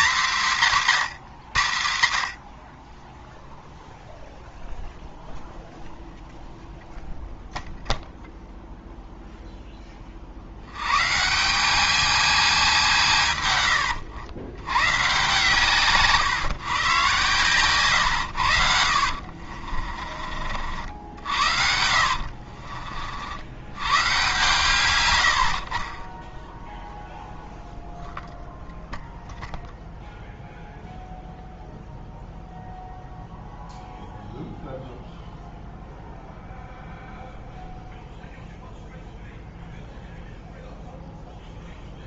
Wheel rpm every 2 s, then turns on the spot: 160, 50, 0, 0, 0, 80, 210, 110, 140, 90, 50, 50, 130, 0, 0, 0, 0, 0, 0, 0, 0.
22-24